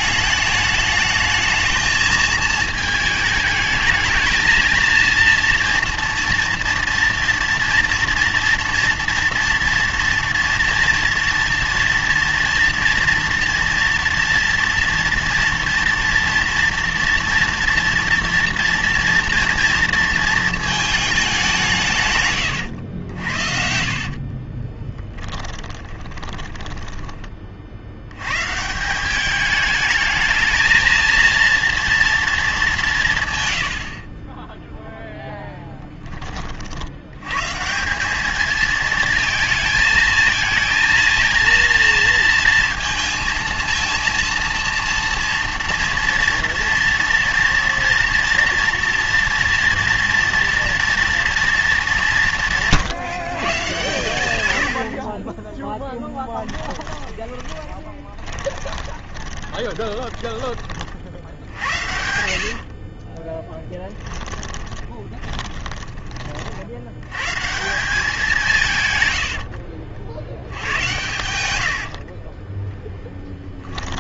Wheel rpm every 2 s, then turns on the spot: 210, 220, 230, 230, 230, 230, 230, 230, 230, 230, 220, 100, 20, 20, 160, 220, 180, 0, 60, 220, 220, 230, 230, 230, 230, 230, 150, 80, 20, 20, 30, 50, 30, 70, 140, 90, 10.
22-28 56-60 62-66